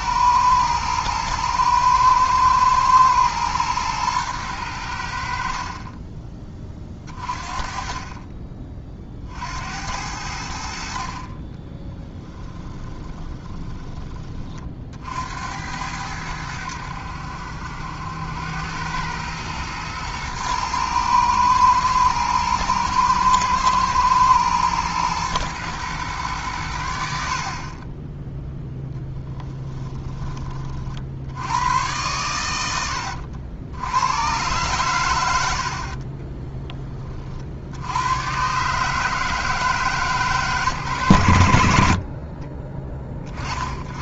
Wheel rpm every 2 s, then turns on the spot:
110, 120, 90, 30, 40, 60, 20, 40, 80, 100, 110, 110, 120, 90, 0, 40, 90, 120, 20, 150, 110, 20.
12-14